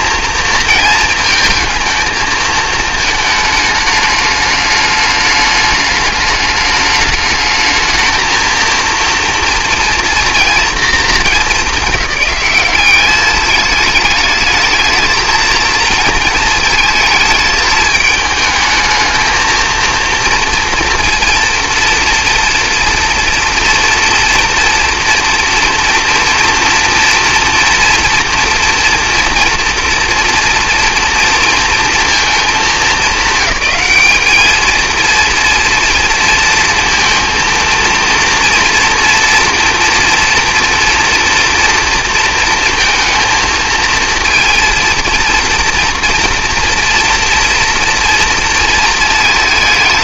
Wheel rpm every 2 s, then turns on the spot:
230, 220, 210, 210, 230, 230, 190, 220, 220, 220, 230, 230, 230, 230, 230, 230, 200, 220, 230, 230, 230, 230, 230, 230, 230.
none